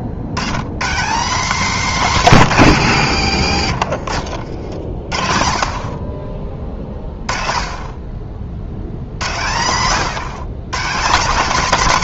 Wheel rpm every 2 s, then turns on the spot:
90, 160, 70, 30, 70, 170.
none